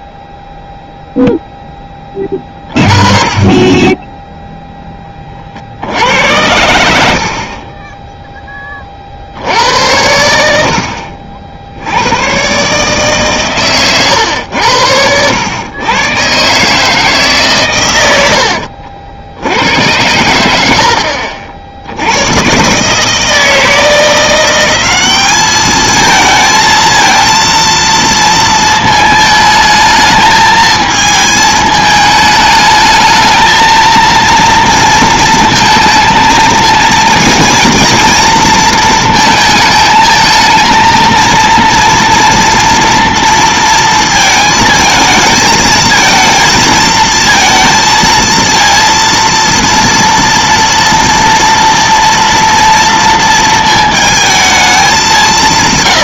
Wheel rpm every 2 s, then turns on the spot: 0, 30, 10, 90, 30, 70, 130, 90, 150, 70, 80, 140, 190, 230, 220, 220, 220, 230, 230, 230, 230, 230, 220, 220, 230, 230, 230, 210.
none